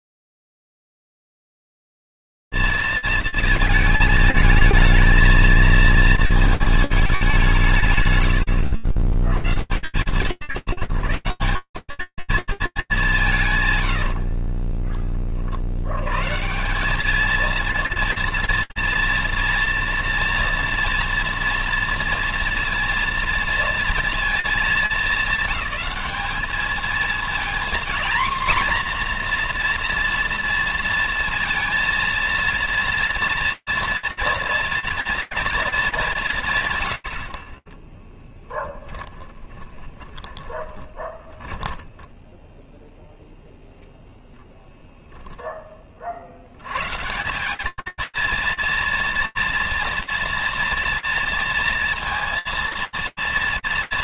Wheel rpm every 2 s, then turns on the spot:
10, 200, 220, 220, 110, 120, 220, 50, 150, 240, 240, 230, 220, 210, 240, 230, 230, 230, 120, 10, 10, 0, 10, 200, 230, 230, 230.
14-16 36-42